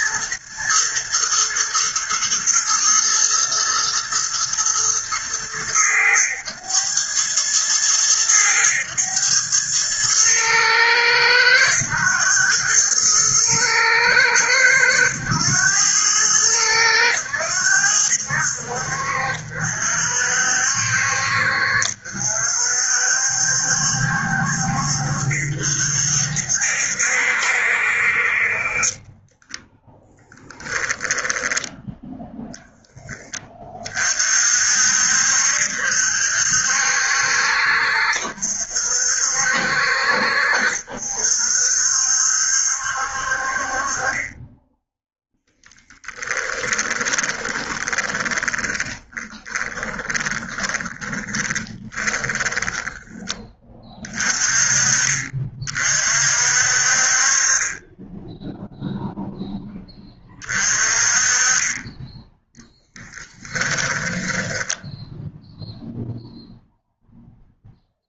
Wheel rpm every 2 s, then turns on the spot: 120, 110, 110, 100, 100, 110, 110, 100, 100, 60, 60, 60, 60, 60, 30, 10, 10, 50, 60, 60, 60, 60, 10, 10, 20, 20, 20, 40, 50, 0, 30, 10, 10, 0.
30-32 46-52 62-64